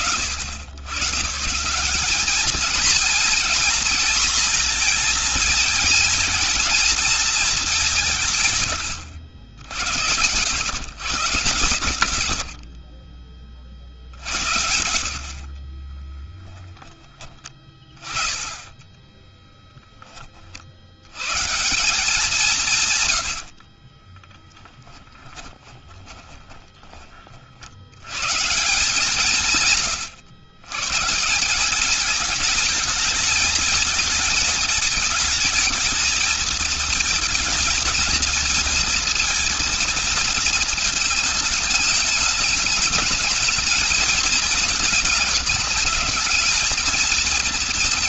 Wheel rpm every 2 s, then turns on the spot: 100, 220, 230, 220, 120, 130, 50, 70, 0, 0, 70, 140, 20, 30, 170, 130, 210, 220, 220, 220, 220, 210, 220, 220.
12-16 22-26